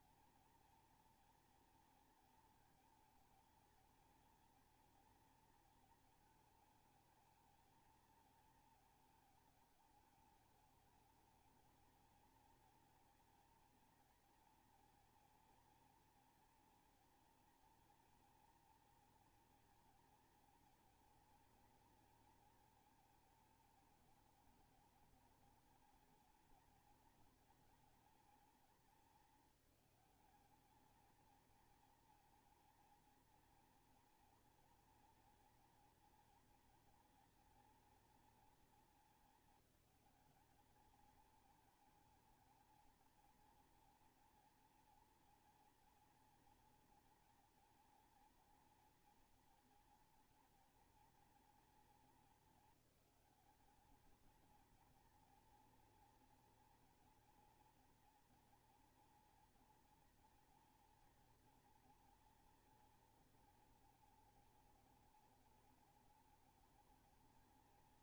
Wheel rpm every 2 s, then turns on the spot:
230, 230, 230, 220, 220, 210, 230, 230, 240, 240, 240, 220, 220, 230, 220, 210, 230, 240, 230, 230, 220, 220, 230, 230, 230, 230, 220, 230, 240, 230, 240, 240, 210, 210.
none